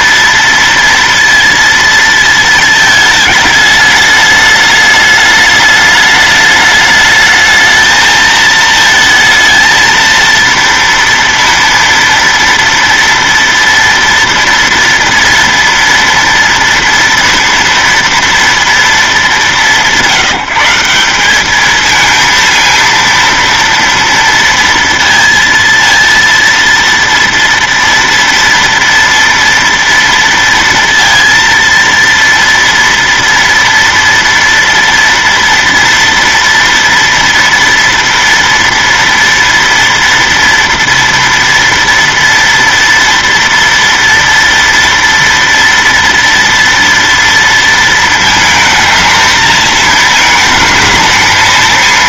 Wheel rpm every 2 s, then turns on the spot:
230, 220, 210, 210, 220, 230, 230, 230, 230, 230, 180, 230, 230, 230, 230, 230, 230, 230, 230, 230, 230, 230, 230, 230, 220, 220.
none